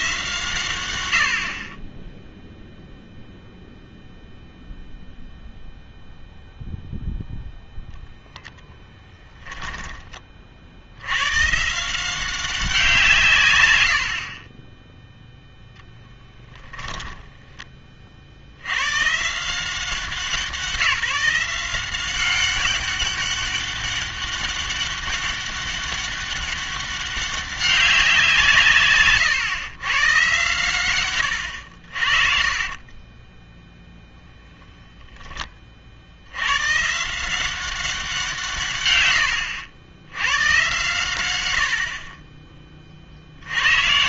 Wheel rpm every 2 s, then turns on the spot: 110, 0, 0, 0, 10, 60, 180, 10, 10, 90, 170, 200, 200, 200, 160, 120, 40, 0, 120, 130, 120, 40.
8-10 14-18 32-34